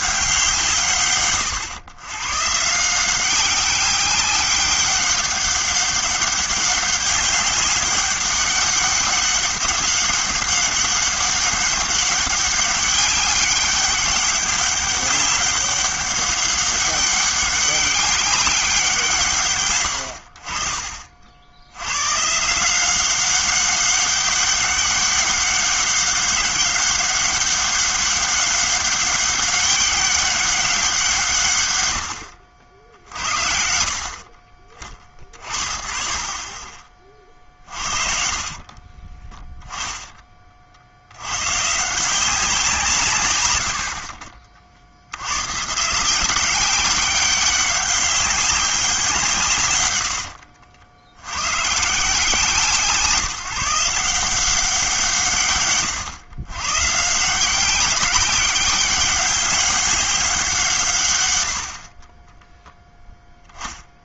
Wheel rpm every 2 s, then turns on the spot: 160, 150, 200, 200, 200, 200, 200, 200, 200, 190, 40, 170, 200, 200, 200, 190, 70, 30, 30, 40, 50, 170, 50, 190, 190, 70, 170, 180, 120, 190, 180, 10.
38-40 50-52